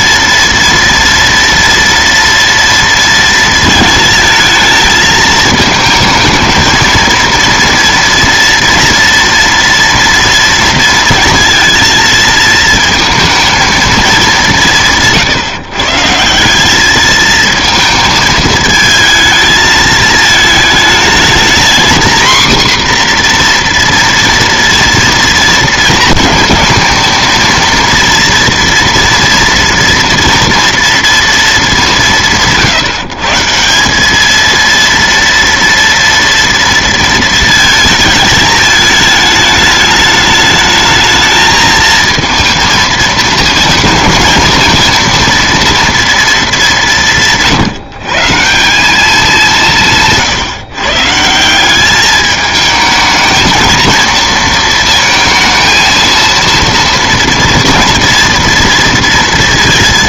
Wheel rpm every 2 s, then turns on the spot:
230, 230, 220, 220, 230, 230, 220, 180, 190, 220, 220, 250, 230, 220, 230, 230, 150, 230, 230, 210, 210, 220, 220, 210, 180, 150, 220, 230, 230, 230.
none